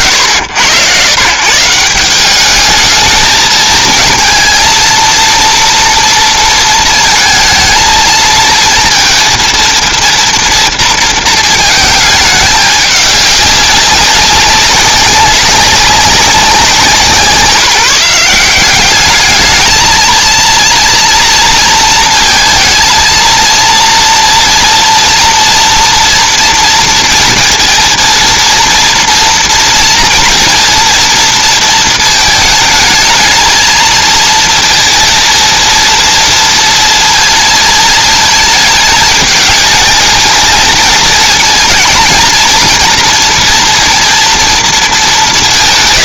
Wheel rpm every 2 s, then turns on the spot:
110, 210, 230, 230, 230, 230, 210, 190, 180, 190, 230, 230, 230, 230, 230, 240, 220, 220, 230, 220, 220, 230, 230.
none